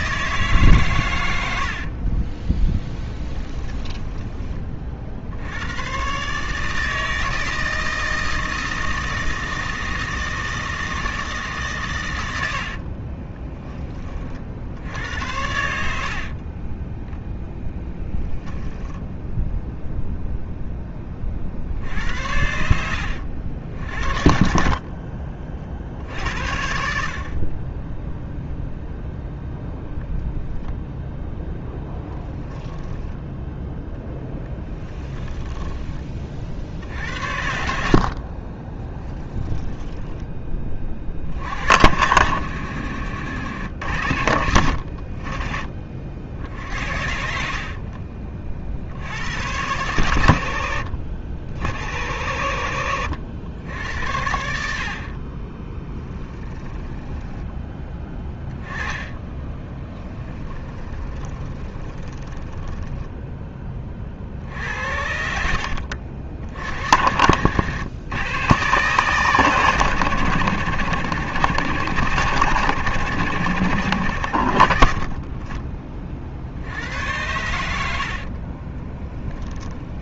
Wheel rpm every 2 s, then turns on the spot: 140, 20, 30, 150, 160, 160, 60, 70, 20, 10, 10, 70, 40, 60, 0, 0, 20, 10, 60, 20, 30, 90, 60, 60, 60, 90, 90, 60, 10, 20, 20, 10, 60, 80, 130, 100, 100, 50, 80, 20.
2-4 12-14 16-18 24-26 32-36 38-40 56-64 78-80